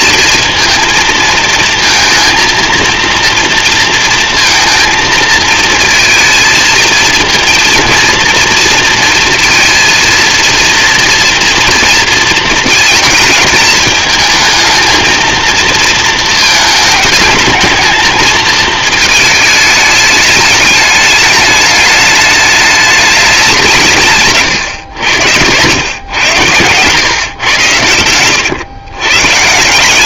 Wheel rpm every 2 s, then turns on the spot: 230, 230, 230, 220, 220, 230, 230, 220, 220, 220, 210, 210, 110, 120, 130.
24-26